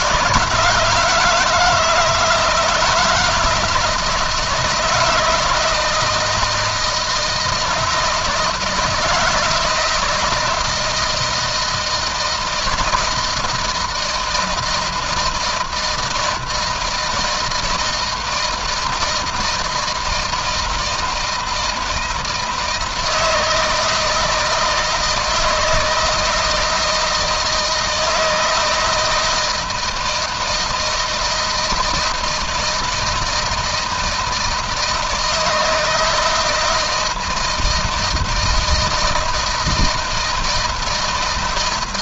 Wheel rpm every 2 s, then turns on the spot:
160, 160, 170, 160, 160, 160, 160, 170, 160, 160, 160, 160, 160, 160, 160, 160, 160, 160, 160, 160, 160.
none